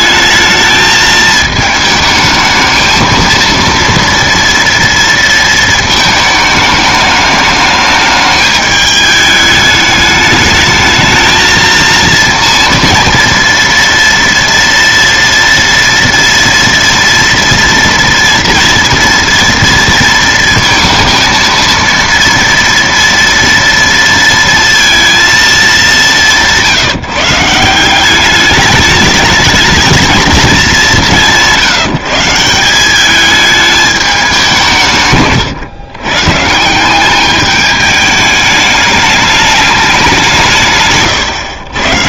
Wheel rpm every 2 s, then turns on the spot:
220, 220, 230, 220, 210, 210, 230, 230, 230, 230, 230, 230, 230, 170, 210, 200, 180, 170, 160, 210, 150.
none